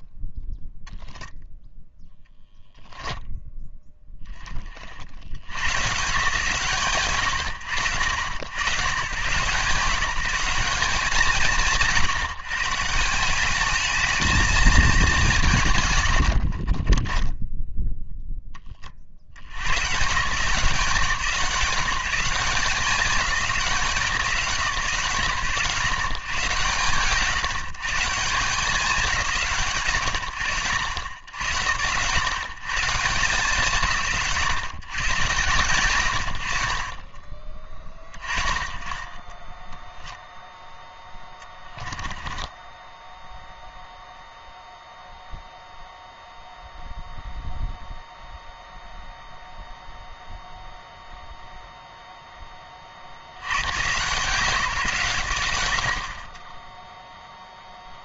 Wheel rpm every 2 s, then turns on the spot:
0, 0, 80, 110, 100, 160, 160, 210, 20, 40, 180, 190, 120, 120, 180, 80, 140, 110, 40, 20, 10, 10, 0, 0, 0, 0, 70, 130, 0.
16-18 36-38 40-44